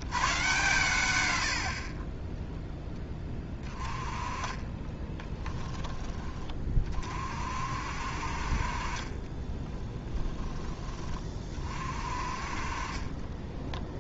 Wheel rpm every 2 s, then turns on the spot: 120, 10, 30, 30, 40, 20, 30.
4-6